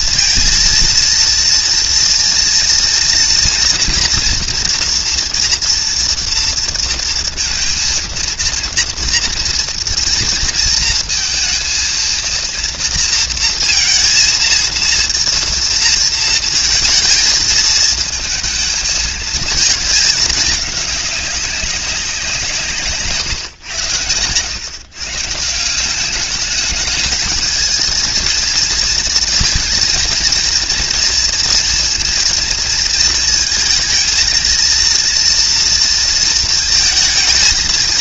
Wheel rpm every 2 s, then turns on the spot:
230, 240, 240, 230, 230, 230, 230, 230, 230, 230, 210, 160, 120, 210, 230, 230, 230, 230, 230.
none